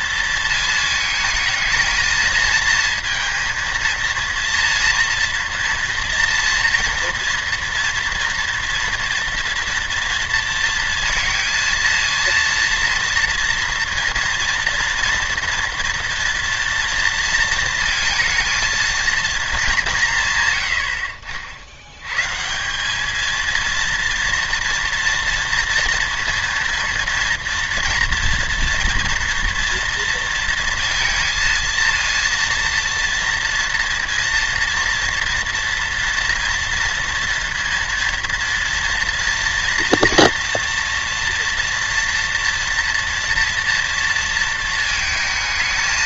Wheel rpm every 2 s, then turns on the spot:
220, 230, 230, 230, 230, 230, 230, 230, 230, 230, 80, 190, 230, 230, 230, 230, 230, 230, 230, 230, 230, 240, 230.
none